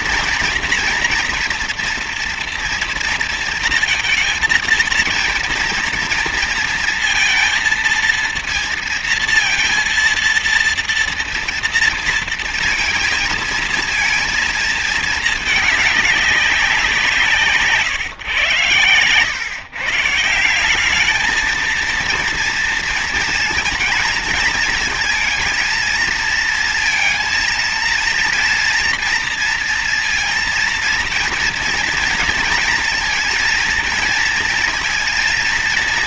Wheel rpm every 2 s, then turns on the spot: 230, 230, 230, 230, 230, 230, 230, 220, 200, 130, 170, 230, 220, 230, 240, 230, 230, 230.
none